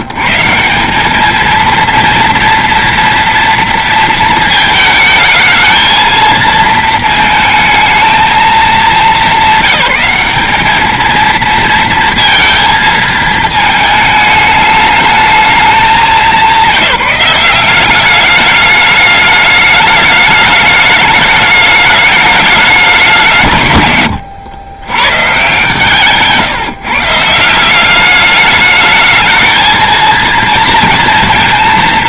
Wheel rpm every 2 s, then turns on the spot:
150, 230, 220, 220, 200, 200, 230, 210, 190, 200, 210, 210, 110, 150, 210, 230.
none